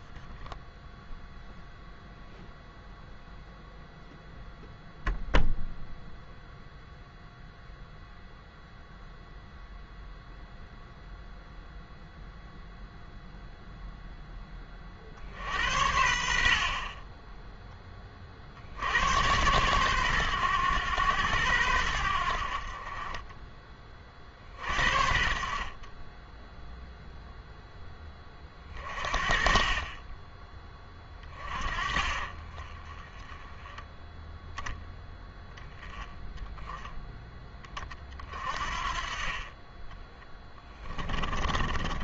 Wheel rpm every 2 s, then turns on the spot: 0, 0, 0, 0, 0, 0, 0, 30, 40, 70, 110, 50, 60, 0, 30, 20, 20, 0, 10, 50, 20.
40-42